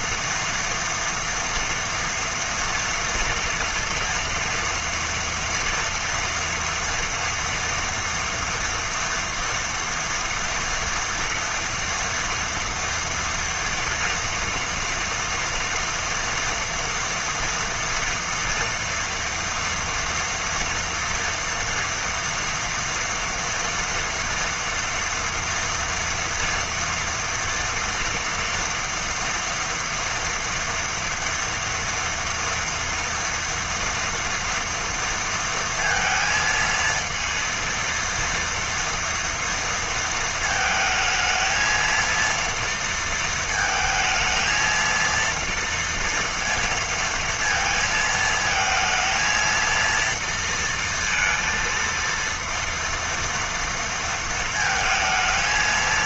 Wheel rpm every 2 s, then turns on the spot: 230, 230, 230, 230, 230, 240, 240, 240, 230, 230, 230, 230, 230, 230, 230, 230, 230, 230, 230, 240, 220, 230, 230, 230, 230, 230, 230, 220.
none